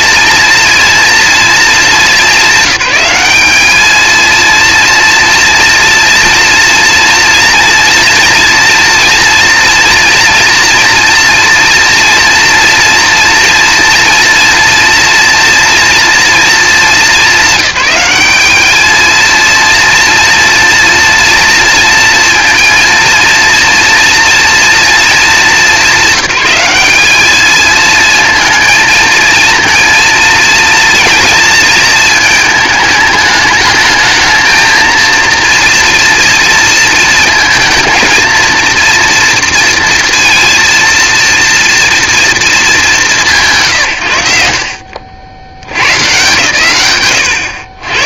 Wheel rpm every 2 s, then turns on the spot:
230, 200, 230, 230, 240, 230, 230, 240, 210, 210, 230, 230, 230, 200, 230, 230, 220, 220, 230, 230, 230, 200, 60, 120.
none